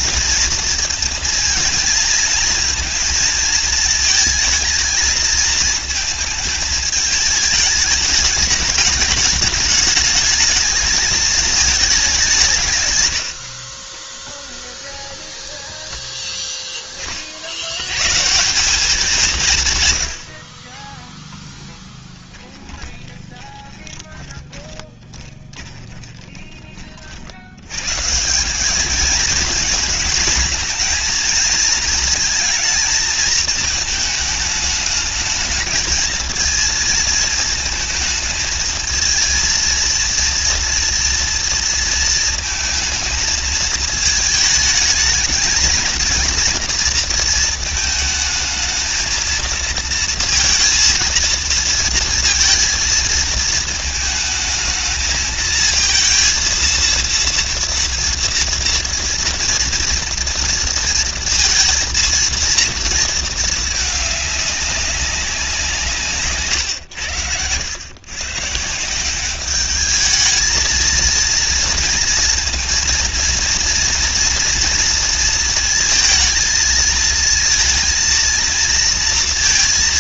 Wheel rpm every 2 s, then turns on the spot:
230, 230, 220, 220, 210, 220, 160, 20, 10, 170, 50, 10, 20, 20, 190, 220, 220, 210, 220, 220, 230, 220, 220, 230, 230, 230, 230, 220, 230, 230, 230, 230, 210, 130, 150, 220, 230, 230, 220, 230.
14-16 22-26